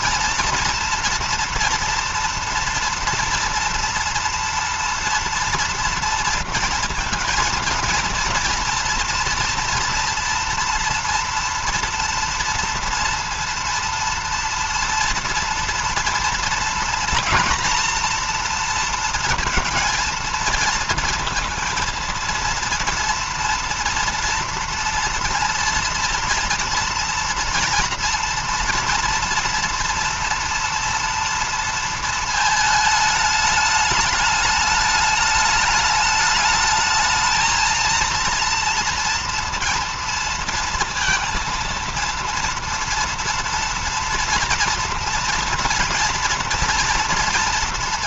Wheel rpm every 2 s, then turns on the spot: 230, 230, 230, 230, 240, 230, 230, 240, 230, 230, 230, 230, 230, 230, 230, 230, 220, 210, 220, 230, 230, 230, 230, 230.
none